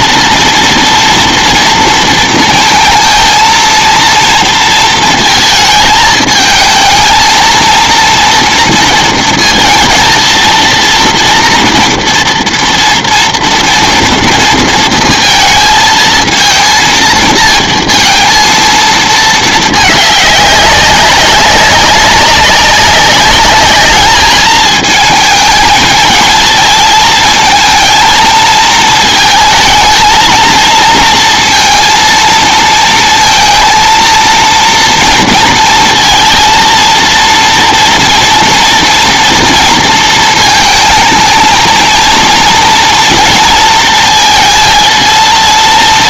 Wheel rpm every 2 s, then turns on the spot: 230, 220, 230, 220, 230, 230, 230, 230, 230, 220, 200, 200, 210, 220, 220, 230, 230, 230, 230, 230, 220, 230, 230.
none